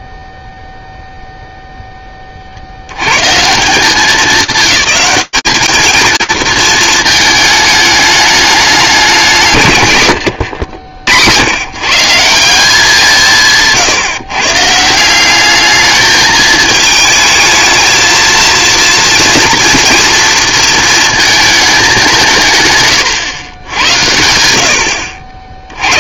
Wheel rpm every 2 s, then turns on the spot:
0, 60, 200, 220, 210, 90, 180, 130, 220, 230, 230, 150, 80.
10-12